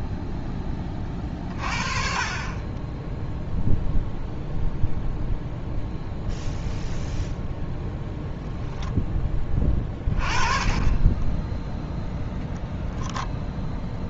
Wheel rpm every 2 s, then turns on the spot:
20, 10, 0, 0, 0, 20, 0.
none